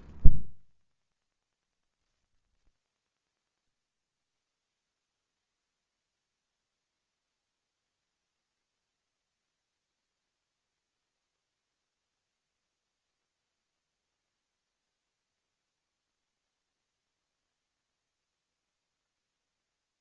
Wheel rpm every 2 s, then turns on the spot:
20, 0, 0, 0, 0, 0, 0, 0, 0, 0.
none